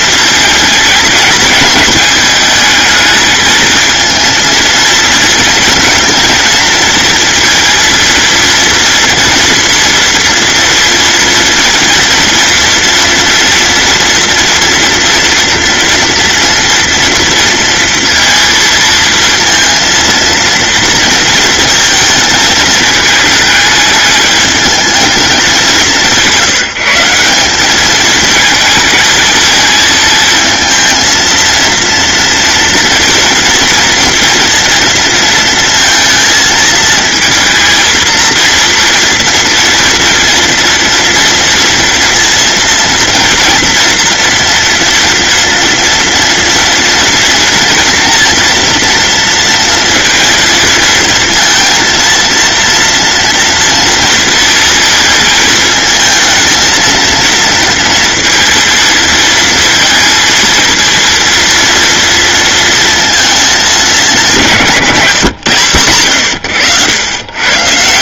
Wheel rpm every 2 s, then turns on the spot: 220, 220, 230, 230, 230, 240, 230, 230, 230, 230, 230, 220, 210, 180, 220, 220, 230, 230, 220, 230, 230, 230, 240, 230, 230, 230, 230, 220, 230, 230, 230, 230, 160, 110.
none